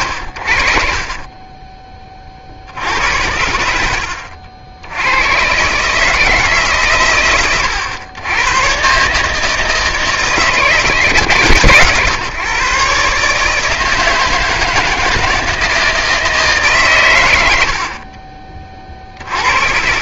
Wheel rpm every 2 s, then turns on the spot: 50, 70, 80, 110, 120, 160, 130, 160, 150, 30.
none